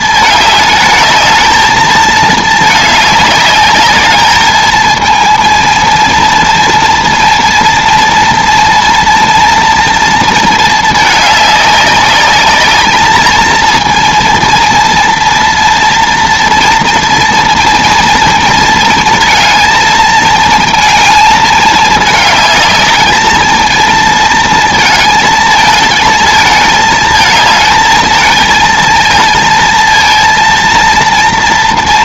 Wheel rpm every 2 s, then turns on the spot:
220, 220, 210, 230, 230, 230, 210, 230, 230, 230, 220, 210, 230, 220, 230, 230.
none